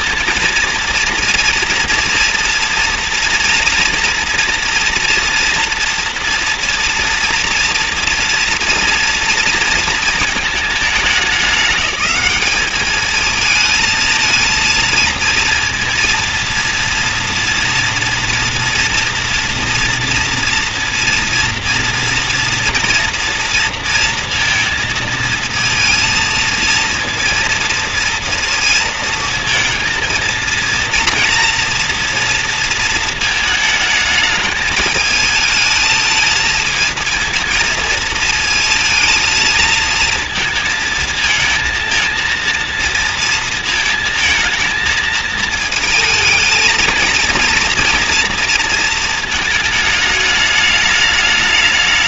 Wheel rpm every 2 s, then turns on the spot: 230, 230, 230, 230, 230, 220, 210, 220, 230, 230, 230, 230, 230, 230, 230, 230, 230, 210, 230, 220, 220, 230, 220, 220, 230, 210.
none